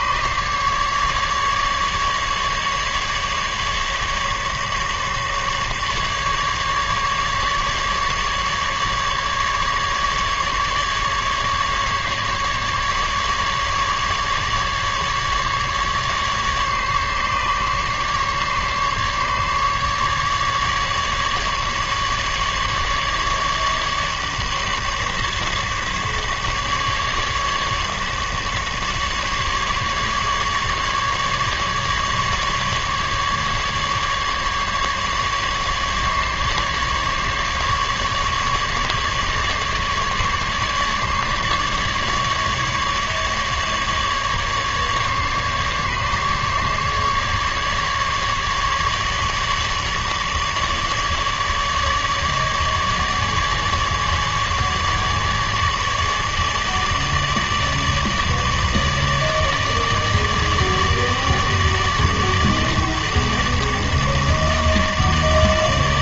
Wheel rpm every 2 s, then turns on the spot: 150, 150, 150, 150, 140, 140, 140, 150, 150, 140, 150, 150, 140, 150, 150, 140, 150, 150, 140, 140, 140, 140, 140, 140, 150, 150, 150, 150, 150, 150, 150, 150, 150.
none